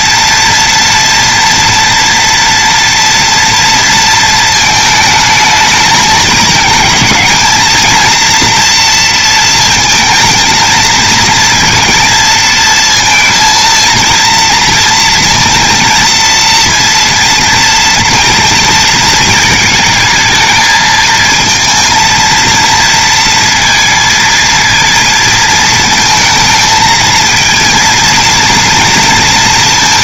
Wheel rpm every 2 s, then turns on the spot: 230, 230, 220, 210, 230, 220, 230, 230, 230, 230, 220, 230, 230, 220, 230.
none